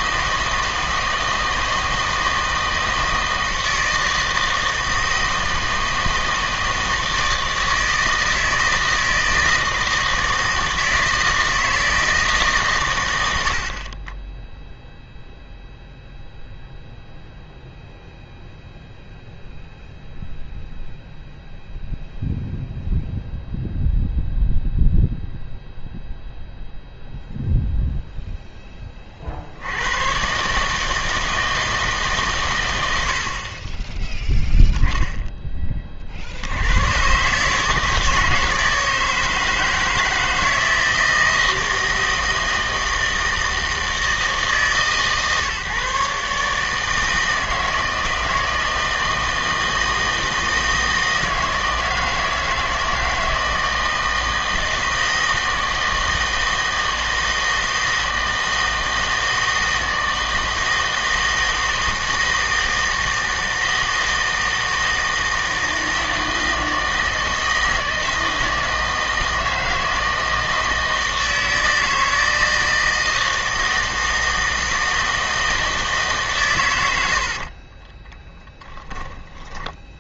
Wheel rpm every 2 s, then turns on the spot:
160, 160, 160, 160, 160, 160, 130, 0, 0, 0, 0, 0, 0, 0, 10, 150, 100, 0, 90, 160, 160, 160, 150, 150, 160, 160, 160, 160, 160, 160, 160, 160, 160, 160, 160, 160, 160, 160, 130, 20.
78-80